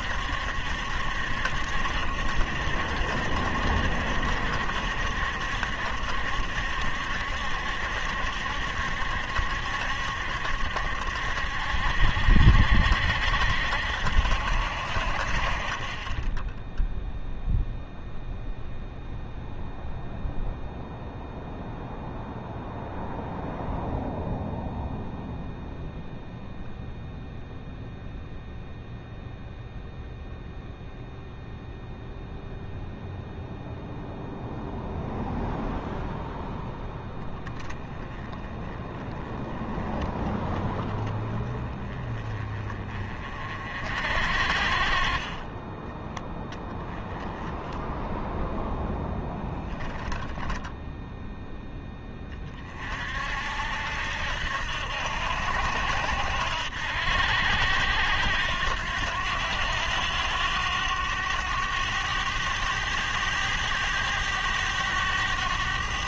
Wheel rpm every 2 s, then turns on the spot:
70, 70, 70, 70, 70, 70, 60, 60, 10, 0, 0, 0, 0, 0, 0, 0, 0, 0, 0, 10, 10, 30, 40, 10, 0, 0, 40, 70, 80, 90, 100, 100, 100.
none